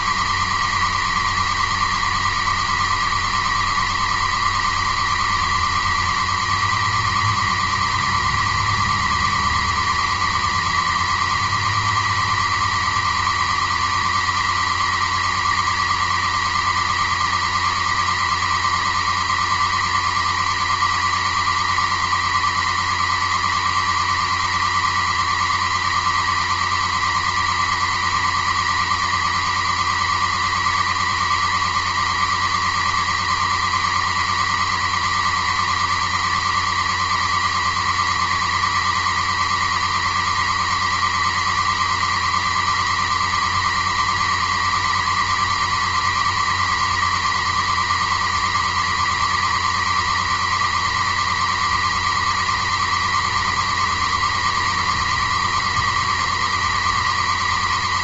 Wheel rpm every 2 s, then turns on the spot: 140, 140, 140, 140, 130, 130, 140, 140, 140, 140, 130, 130, 130, 130, 130, 140, 140, 130, 140, 130, 130, 140, 140, 130, 130, 140, 130, 130, 140.
none